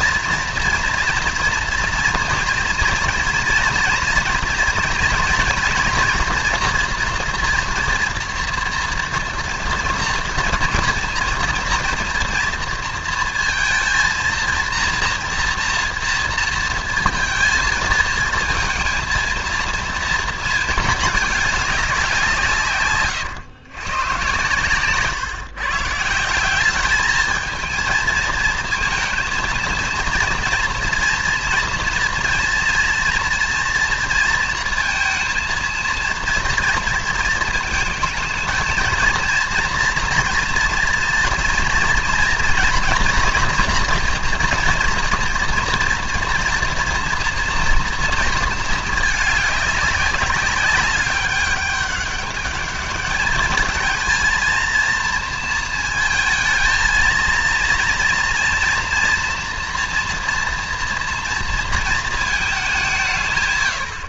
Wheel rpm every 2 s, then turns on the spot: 240, 240, 230, 240, 230, 230, 230, 230, 230, 230, 220, 140, 120, 200, 220, 240, 230, 230, 230, 220, 230, 240, 240, 230, 220, 200, 200, 230, 220, 230, 230, 190.
none